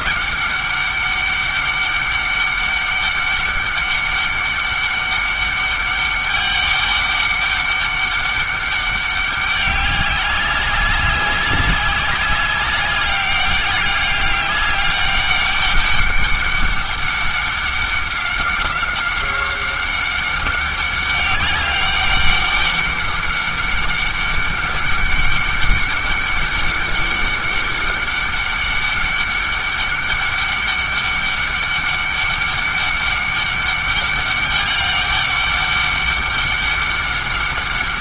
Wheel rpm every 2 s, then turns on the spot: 200, 200, 200, 200, 200, 190, 200, 200, 200, 190, 190, 200, 200, 200, 200, 200, 200, 200, 200.
none